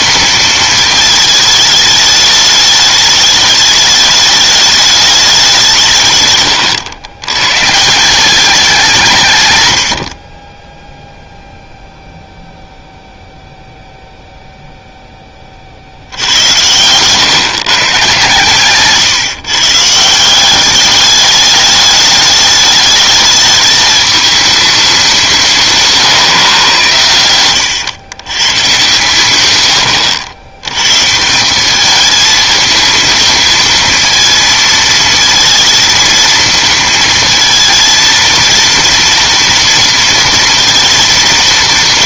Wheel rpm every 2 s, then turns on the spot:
220, 210, 210, 110, 190, 20, 0, 0, 100, 140, 200, 220, 210, 120, 120, 100, 220, 230, 230, 230, 230.
6-8